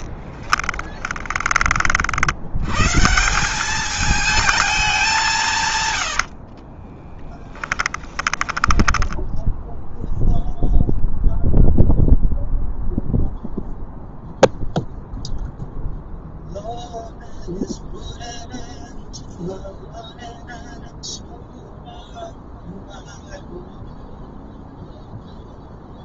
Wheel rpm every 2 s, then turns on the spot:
10, 150, 190, 20, 10, 0, 0, 0, 0, 0, 0, 0, 0.
6-10